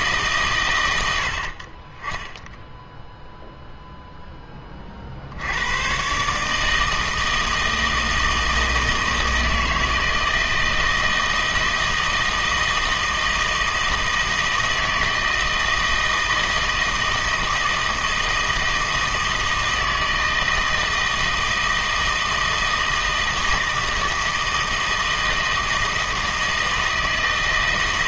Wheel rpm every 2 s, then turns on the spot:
120, 0, 20, 160, 160, 160, 160, 160, 160, 160, 160, 160, 160, 160.
none